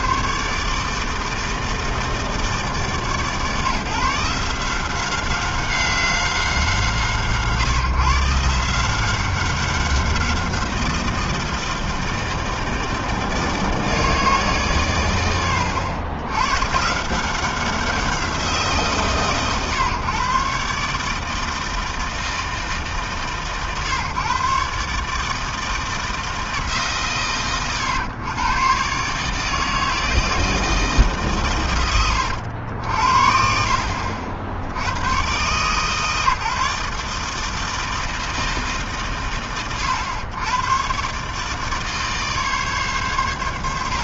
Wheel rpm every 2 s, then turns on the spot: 160, 150, 190, 130, 190, 160, 160, 80, 180, 130, 160, 130, 160, 100, 160, 130, 50, 130, 160, 90, 150, 110.
none